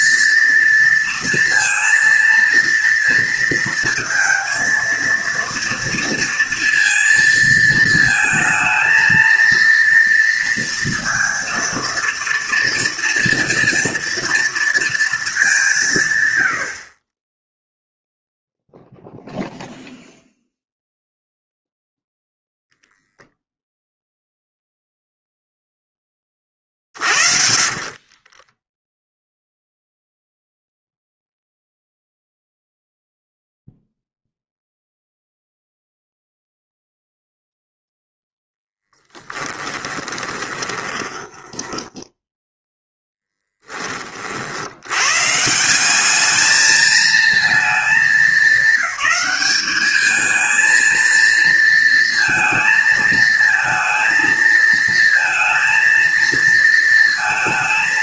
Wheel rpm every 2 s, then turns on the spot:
230, 230, 230, 230, 230, 230, 230, 230, 60, 0, 0, 0, 0, 40, 0, 0, 0, 0, 0, 0, 20, 0, 100, 220, 210, 230, 220, 230, 230.
26-28 40-42